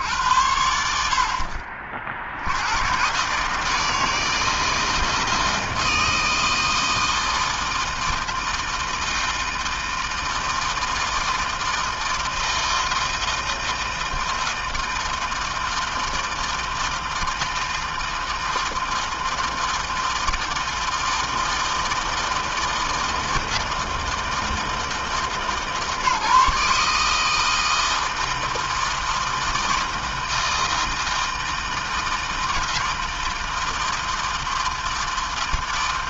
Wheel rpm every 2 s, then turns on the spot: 70, 130, 160, 160, 160, 160, 160, 160, 160, 160, 160, 160, 160, 160, 160, 160, 160, 160.
none